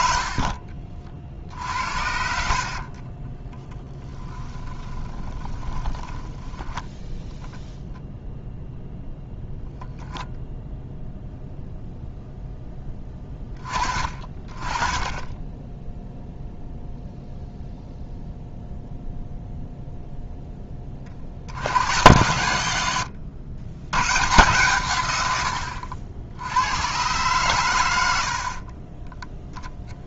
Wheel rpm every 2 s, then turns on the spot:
50, 30, 10, 0, 0, 0, 10, 30, 0, 0, 40, 100, 120, 110, 30.
2-6